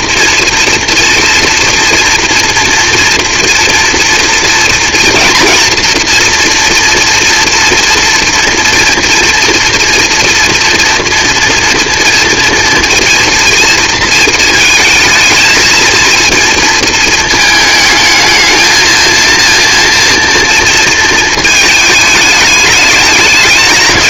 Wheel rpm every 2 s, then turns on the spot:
230, 230, 230, 230, 230, 230, 240, 220, 230, 220, 230, 210.
none